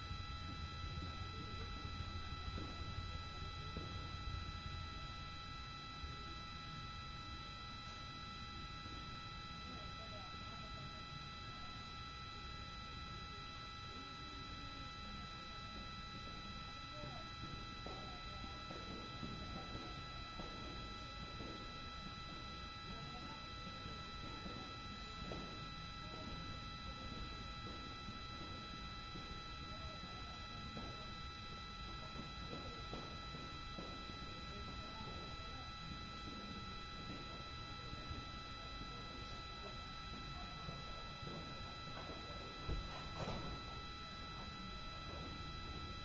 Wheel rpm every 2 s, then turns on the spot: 0, 0, 0, 0, 0, 0, 0, 0, 0, 0, 0, 0, 0, 0, 0, 0, 0, 0, 0, 0, 0, 0, 0.
none